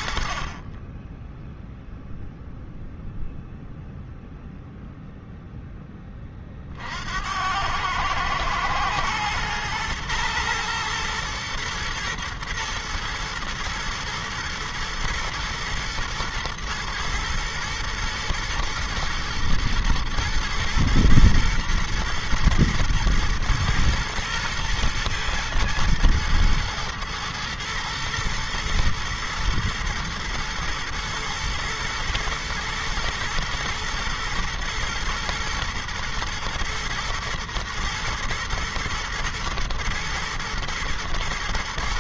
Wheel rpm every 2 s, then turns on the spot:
40, 0, 0, 40, 110, 120, 110, 110, 120, 120, 110, 120, 120, 110, 110, 110, 110, 120, 120, 110, 110.
none